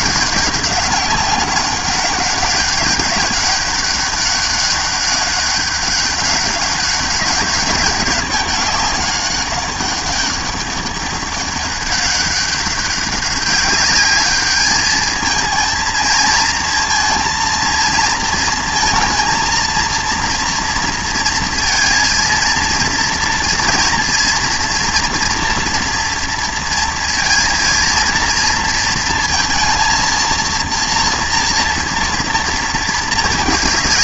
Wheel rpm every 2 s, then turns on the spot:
200, 200, 200, 200, 200, 200, 200, 210, 230, 230, 230, 230, 230, 230, 230, 230, 230.
none